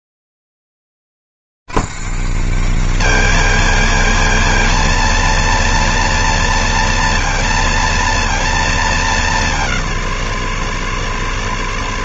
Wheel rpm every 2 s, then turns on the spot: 90, 180, 120, 120, 110, 100.
none